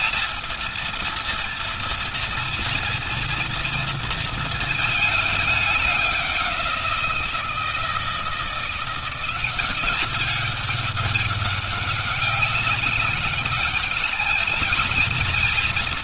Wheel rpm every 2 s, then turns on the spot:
230, 230, 230, 190, 170, 200, 200, 220.
none